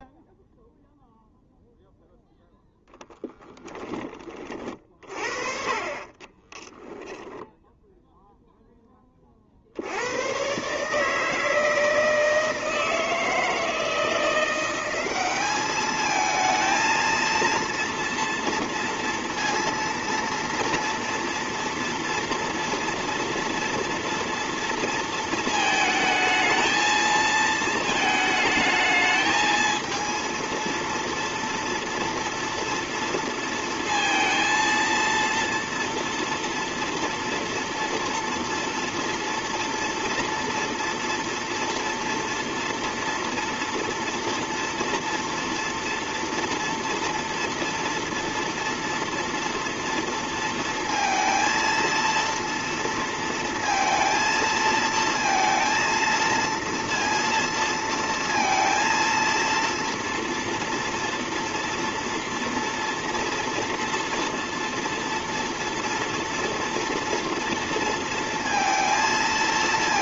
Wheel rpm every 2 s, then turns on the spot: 0, 10, 30, 20, 0, 130, 160, 180, 220, 230, 230, 230, 230, 220, 220, 230, 230, 230, 230, 230, 230, 230, 230, 230, 230, 230, 230, 230, 230, 230, 230, 240, 230, 230, 230.
6-8